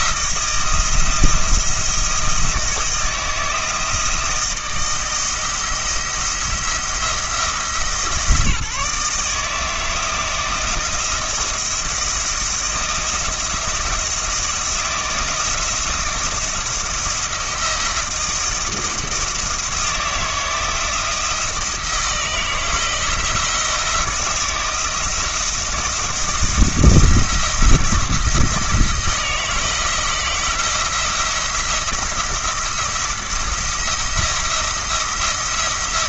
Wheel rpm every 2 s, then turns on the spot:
160, 160, 160, 170, 160, 160, 170, 170, 170, 170, 170, 160, 160, 170, 160, 170, 170, 170.
none